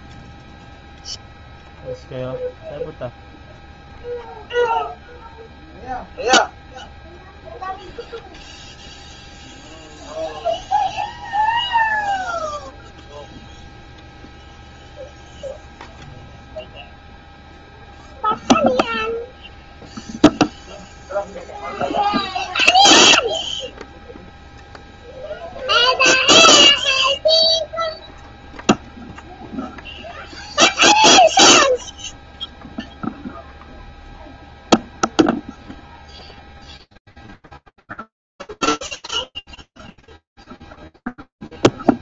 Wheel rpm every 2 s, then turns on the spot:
0, 0, 0, 0, 0, 0, 0, 0, 0, 0, 0, 0, 0, 0, 0, 0, 0, 0, 0, 0, 0.
none